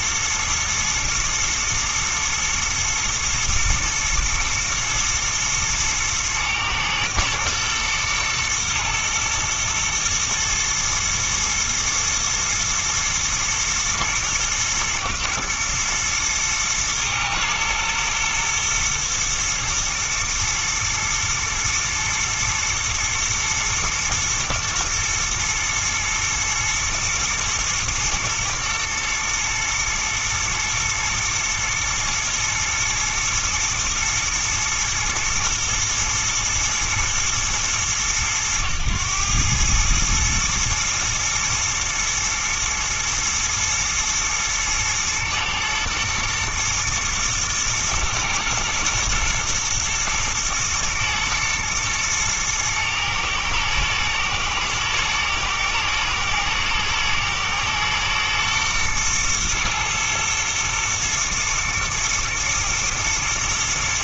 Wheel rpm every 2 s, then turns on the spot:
110, 110, 110, 110, 110, 120, 120, 120, 110, 120, 120, 120, 110, 110, 120, 110, 110, 110, 110, 110, 110, 120, 110, 120, 110, 120, 110, 120, 120, 120, 110, 110.
none